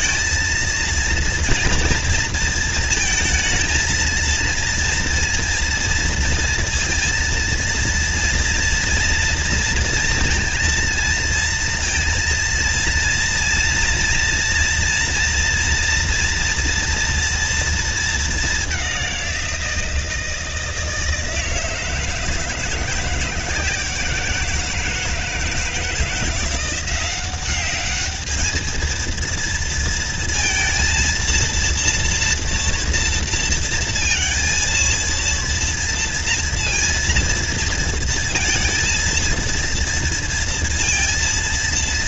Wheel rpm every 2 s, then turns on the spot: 230, 230, 230, 230, 230, 230, 230, 230, 230, 210, 170, 160, 170, 170, 220, 230, 230, 230, 230, 230, 230.
none